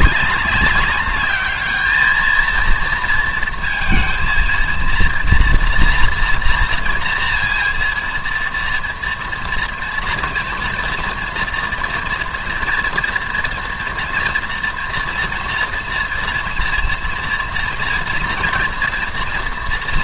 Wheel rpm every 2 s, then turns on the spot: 200, 230, 230, 230, 230, 230, 230, 230, 230, 230.
none